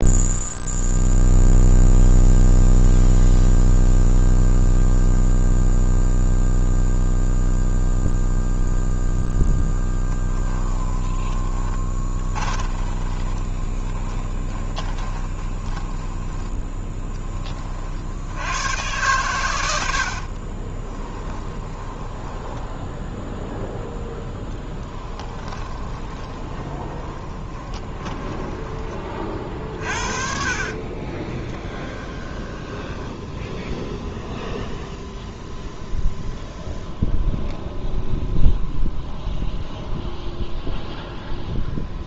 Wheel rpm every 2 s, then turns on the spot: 0, 0, 0, 0, 0, 20, 20, 10, 10, 90, 40, 10, 10, 20, 20, 40, 10, 0, 0, 0, 0.
10-18 20-28 30-34